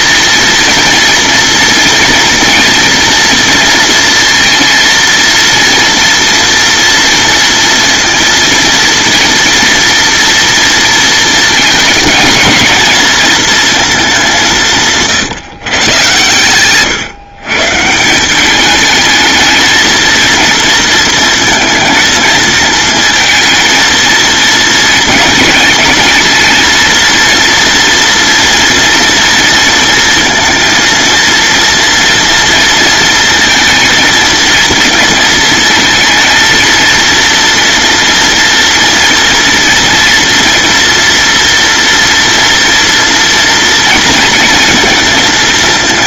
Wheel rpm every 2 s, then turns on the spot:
230, 230, 230, 230, 230, 230, 230, 150, 130, 210, 230, 220, 230, 230, 230, 230, 230, 230, 230, 230, 230, 240, 230.
none